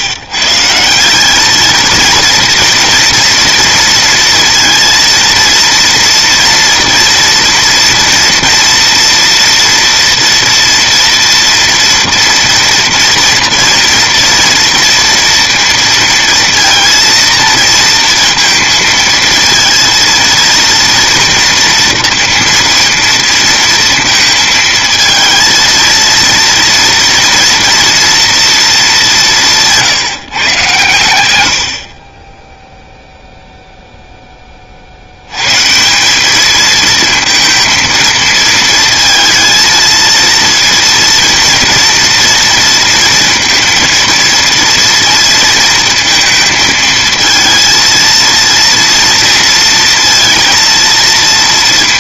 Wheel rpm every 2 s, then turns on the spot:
170, 230, 230, 230, 230, 230, 230, 230, 230, 230, 230, 230, 220, 230, 210, 120, 0, 40, 220, 230, 230, 230, 230, 220, 230, 230.
none